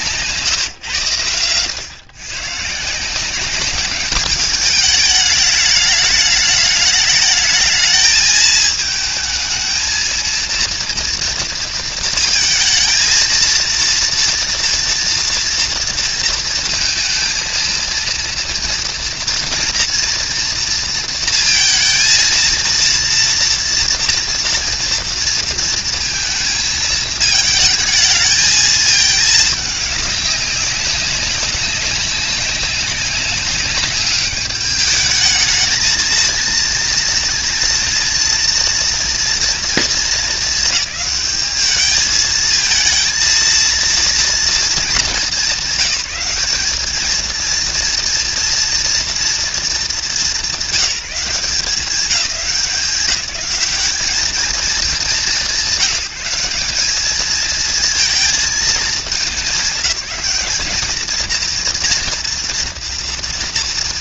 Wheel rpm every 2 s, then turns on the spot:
160, 140, 210, 210, 220, 230, 230, 230, 230, 230, 230, 230, 230, 220, 220, 190, 200, 210, 230, 230, 210, 220, 220, 200, 230, 170, 200, 200, 190, 220, 210, 230.
none